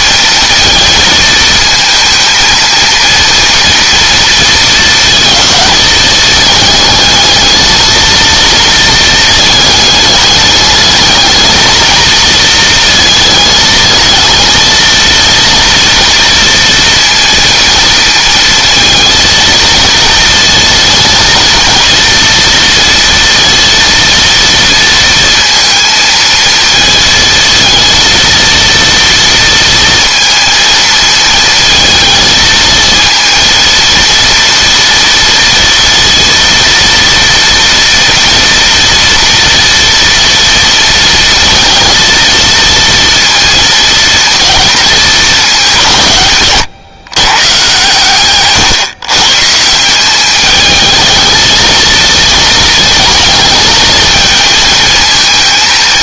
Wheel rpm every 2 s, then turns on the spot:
220, 220, 220, 220, 230, 210, 220, 220, 230, 230, 230, 230, 230, 220, 230, 230, 230, 230, 230, 230, 230, 230, 220, 130, 130, 220, 230, 230.
none